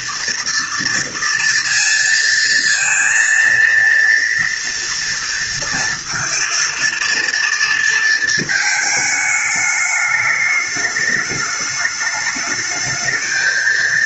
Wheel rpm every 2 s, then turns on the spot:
230, 230, 230, 230, 210, 210, 220.
none